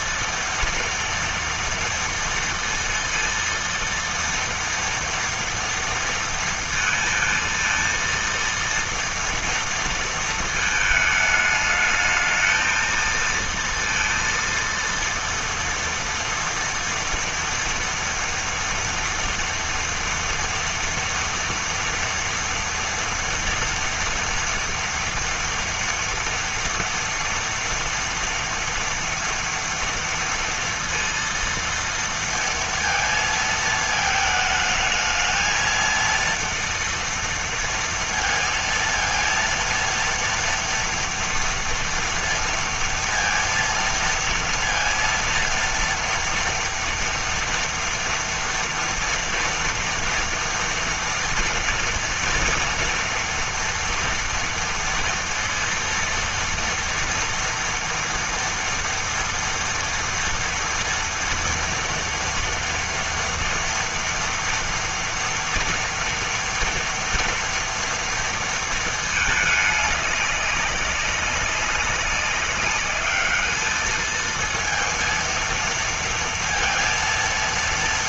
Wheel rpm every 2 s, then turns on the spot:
230, 230, 230, 230, 230, 220, 230, 230, 230, 240, 230, 230, 230, 230, 230, 230, 230, 220, 230, 230, 230, 230, 230, 230, 230, 230, 230, 230, 230, 230, 230, 230, 230, 230, 220, 190, 210, 230, 230.
none